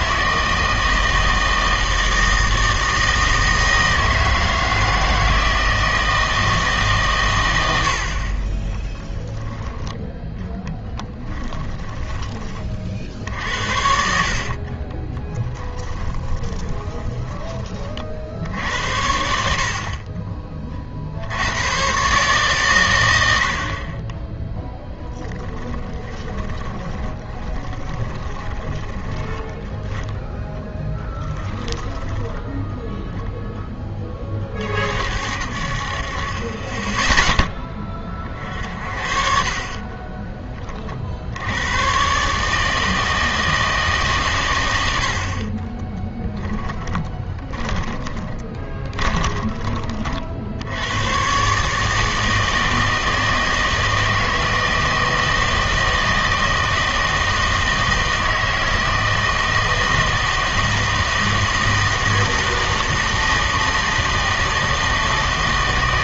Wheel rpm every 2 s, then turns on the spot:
160, 160, 160, 150, 20, 30, 40, 30, 20, 70, 30, 120, 0, 20, 20, 10, 0, 50, 20, 50, 30, 150, 100, 10, 20, 80, 160, 160, 160, 160, 160, 160, 160.
8-12 14-18 26-32 46-50